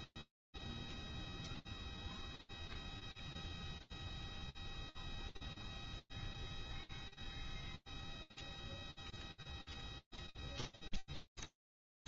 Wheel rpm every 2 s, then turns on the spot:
0, 0, 0, 0, 0, 0.
none